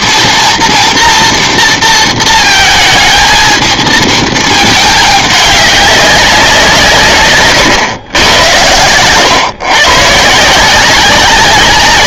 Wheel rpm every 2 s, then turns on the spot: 240, 220, 220, 180, 110, 170.
none